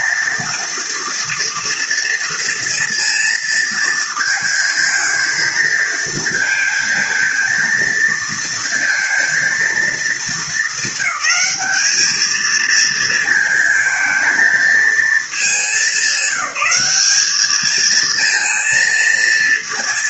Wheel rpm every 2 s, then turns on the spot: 230, 230, 230, 230, 230, 200, 230, 210, 210, 230.
none